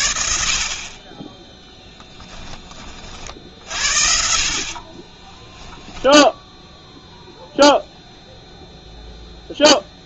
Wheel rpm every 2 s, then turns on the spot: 40, 30, 40, 0, 0.
4-6